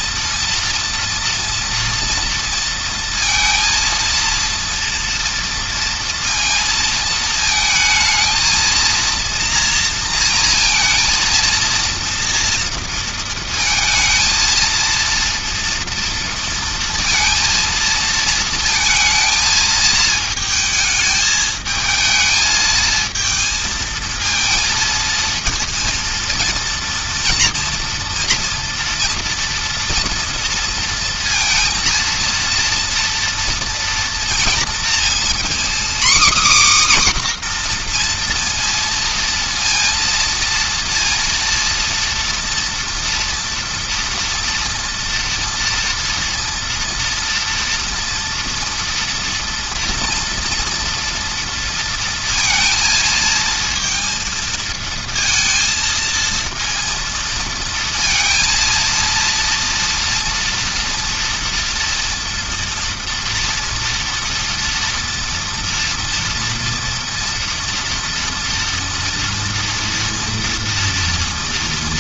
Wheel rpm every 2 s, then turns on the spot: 240, 230, 230, 230, 230, 230, 230, 230, 230, 220, 220, 220, 230, 230, 230, 230, 230, 230, 270, 230, 230, 230, 230, 230, 240, 230, 230, 230, 230, 230, 230, 230, 230, 230, 230, 230.
none